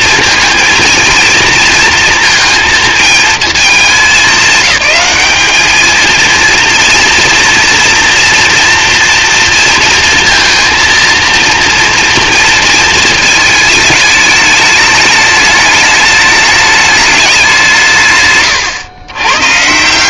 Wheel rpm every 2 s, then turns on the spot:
230, 230, 210, 230, 230, 230, 230, 210, 210, 130.
none